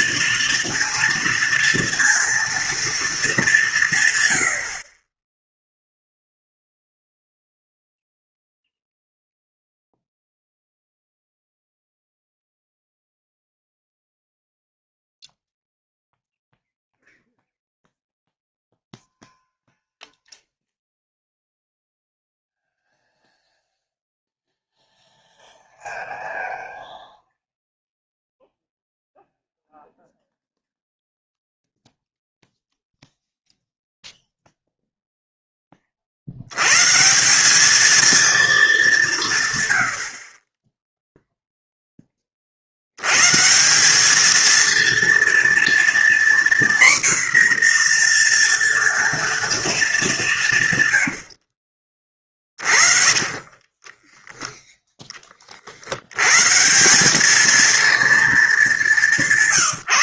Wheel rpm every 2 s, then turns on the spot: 230, 230, 80, 0, 0, 0, 0, 0, 0, 0, 0, 0, 0, 0, 0, 0, 0, 0, 120, 220, 20, 70, 230, 250, 240, 140, 40, 10, 160, 210.
52-54